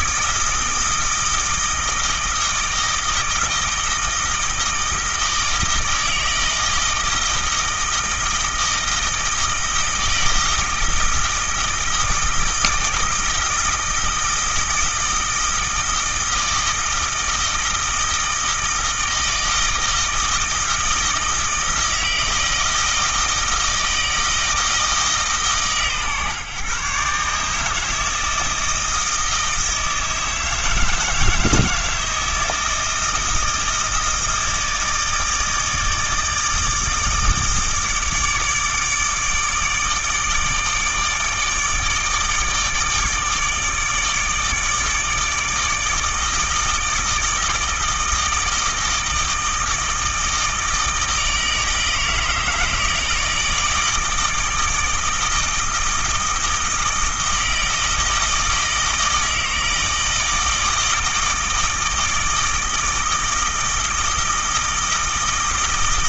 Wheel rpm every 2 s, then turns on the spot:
160, 160, 160, 160, 160, 160, 160, 160, 160, 160, 160, 160, 160, 140, 160, 160, 160, 160, 160, 160, 160, 150, 150, 160, 160, 160, 160, 160, 160, 160, 160, 160, 160.
none